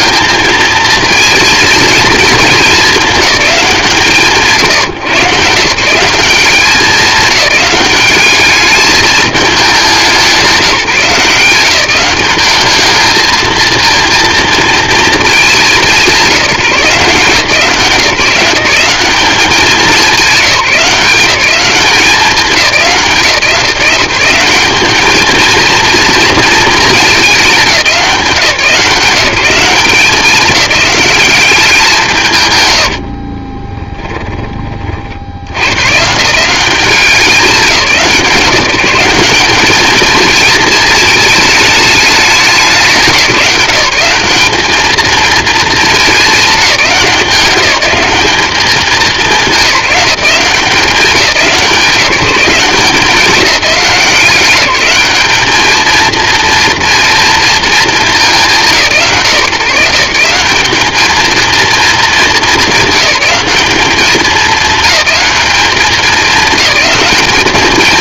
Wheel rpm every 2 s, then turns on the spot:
220, 210, 150, 190, 210, 180, 210, 230, 170, 200, 180, 170, 200, 220, 180, 200, 100, 30, 180, 180, 220, 190, 220, 200, 190, 190, 190, 200, 230, 160, 200, 210, 200, 210.
none